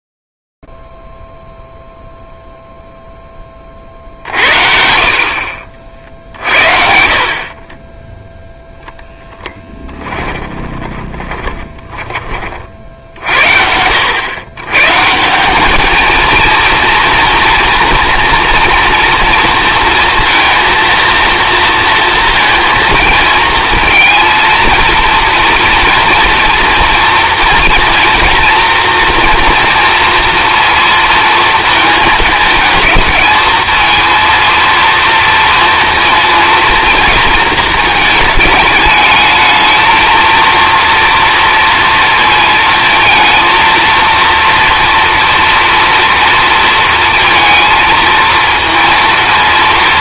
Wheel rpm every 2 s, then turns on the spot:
0, 0, 60, 50, 0, 20, 50, 130, 230, 240, 230, 230, 230, 240, 230, 230, 210, 230, 230, 210, 230, 220, 230, 230, 230.
10-12